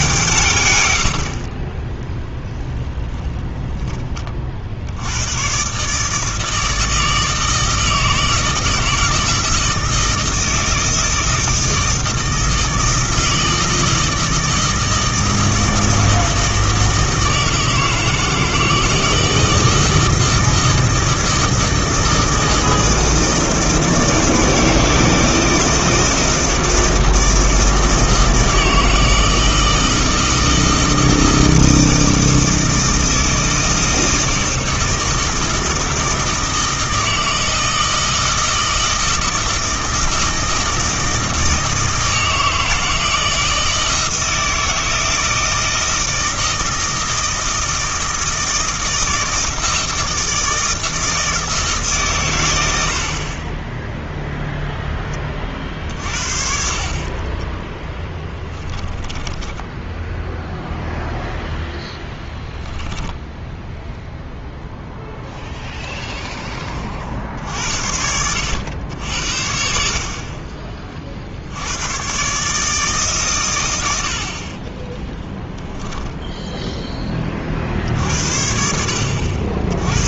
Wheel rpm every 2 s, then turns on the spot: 130, 0, 50, 160, 160, 160, 160, 160, 160, 160, 160, 160, 160, 160, 160, 160, 160, 160, 160, 160, 160, 160, 160, 160, 160, 160, 80, 0, 50, 10, 0, 10, 0, 30, 90, 30, 150, 20, 10, 60.
58-60 62-64 74-76